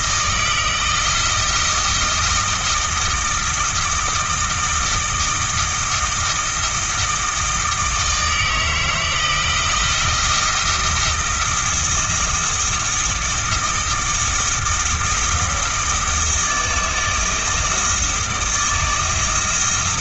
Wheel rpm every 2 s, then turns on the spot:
160, 160, 160, 160, 160, 170, 160, 160, 160, 160.
none